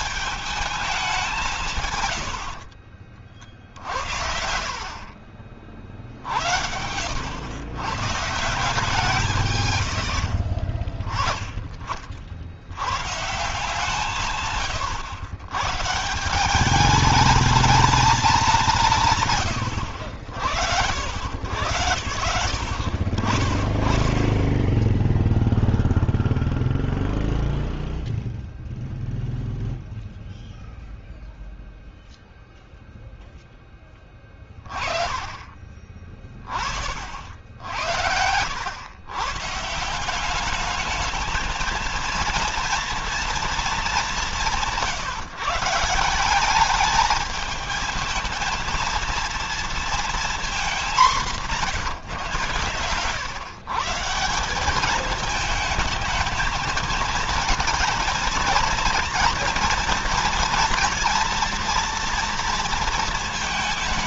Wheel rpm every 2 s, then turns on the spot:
210, 50, 50, 80, 160, 30, 90, 120, 200, 170, 70, 60, 10, 0, 0, 0, 0, 20, 50, 110, 210, 230, 170, 200, 220, 220, 110, 200, 220, 230, 240, 230.
2-4